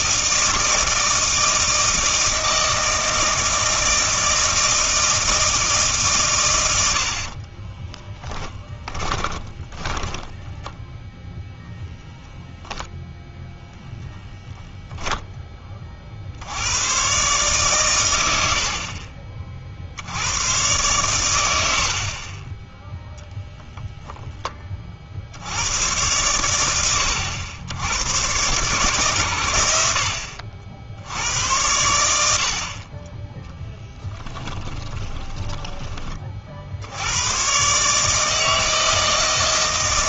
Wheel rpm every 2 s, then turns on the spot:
160, 160, 160, 90, 20, 10, 0, 0, 100, 70, 110, 10, 10, 110, 130, 70, 40, 20, 60, 160.
8-12 34-36